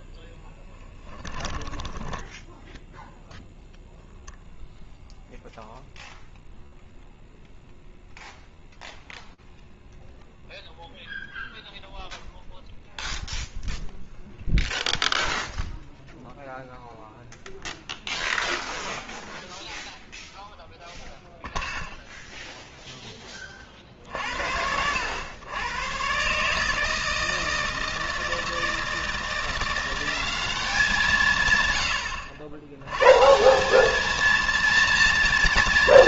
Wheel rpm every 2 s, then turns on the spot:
10, 20, 0, 0, 0, 0, 0, 0, 0, 0, 0, 40, 110, 160, 180, 120, 190, 230.
2-4